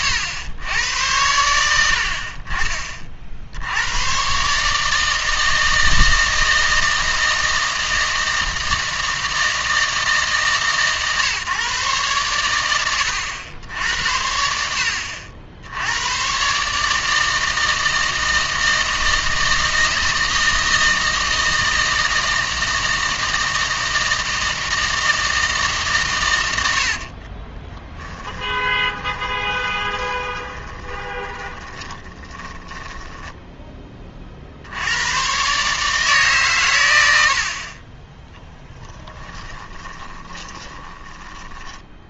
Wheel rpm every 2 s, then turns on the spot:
100, 40, 150, 160, 160, 140, 100, 70, 140, 160, 160, 160, 160, 80, 20, 20, 20, 80, 100, 10, 10.
28-34 38-42